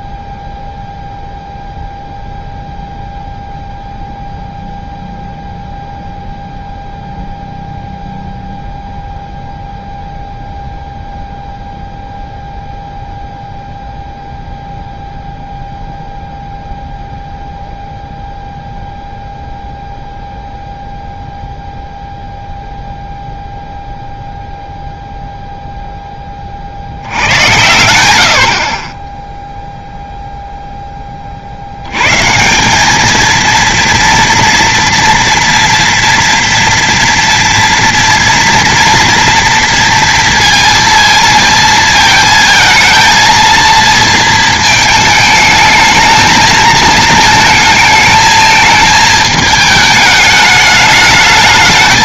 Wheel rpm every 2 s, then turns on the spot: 0, 0, 0, 0, 0, 0, 0, 0, 0, 0, 0, 0, 0, 40, 70, 0, 170, 230, 230, 230, 230, 220, 220, 220, 220, 210.
none